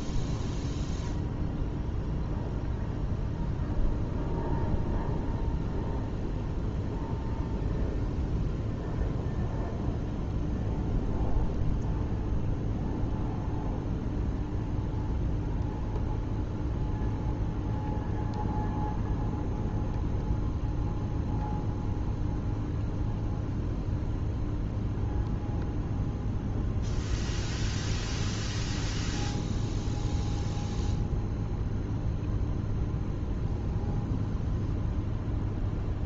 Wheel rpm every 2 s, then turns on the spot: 0, 0, 0, 0, 0, 0, 0, 0, 0, 0, 0, 0, 0, 0, 0, 0, 0, 0.
none